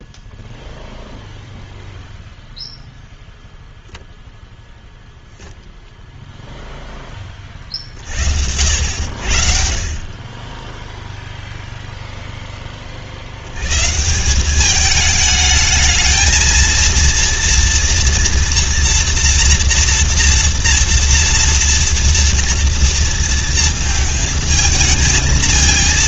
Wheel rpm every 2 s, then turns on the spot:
0, 0, 0, 0, 70, 10, 20, 200, 230, 230, 230, 230, 220.
none